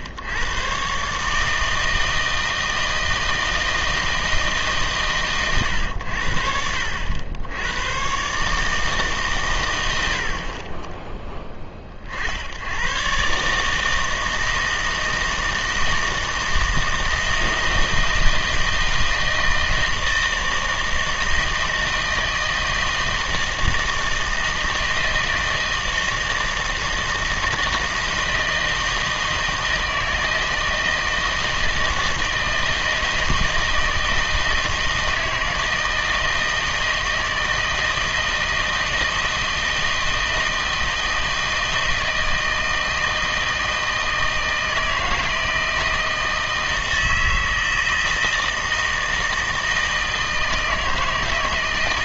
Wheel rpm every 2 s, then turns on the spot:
120, 160, 150, 70, 150, 20, 100, 160, 160, 160, 160, 160, 160, 160, 160, 160, 160, 160, 160, 160, 160, 160, 160, 160, 160, 160.
none